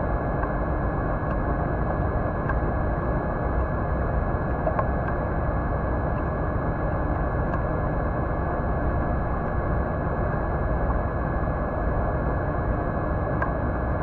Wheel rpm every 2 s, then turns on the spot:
0, 0, 0, 0, 0, 0, 0.
none